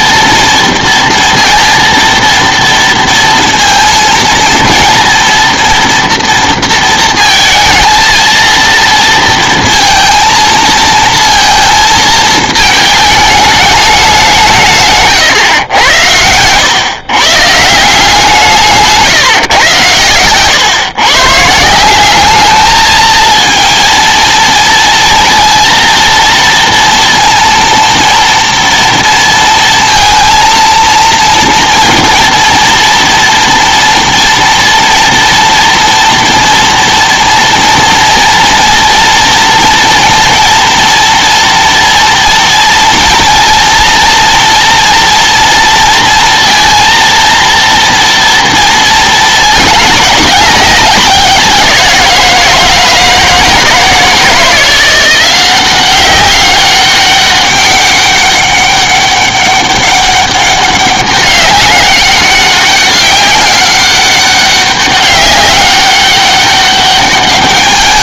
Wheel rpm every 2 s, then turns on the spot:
230, 230, 230, 230, 230, 230, 220, 170, 100, 160, 130, 210, 230, 230, 230, 230, 230, 230, 230, 230, 230, 230, 230, 230, 230, 200, 170, 170, 200, 200, 200, 200, 200, 200.
none